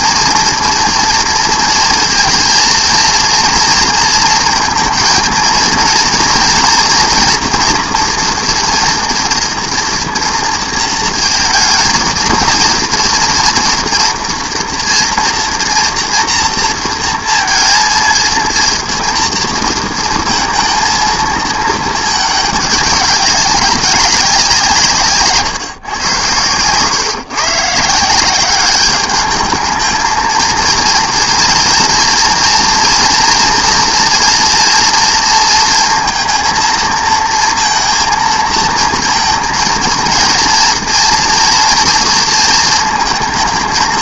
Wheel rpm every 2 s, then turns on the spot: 230, 230, 230, 230, 230, 230, 220, 230, 230, 230, 230, 210, 170, 120, 200, 230, 230, 230, 230, 230, 240, 220.
none